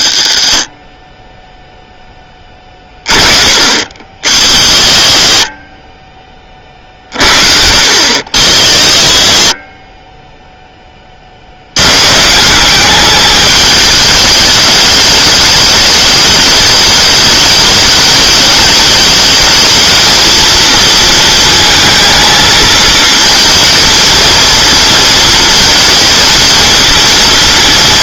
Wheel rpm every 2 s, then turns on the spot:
50, 20, 50, 40, 50, 10, 180, 210, 210, 210, 230, 220, 230, 230.
none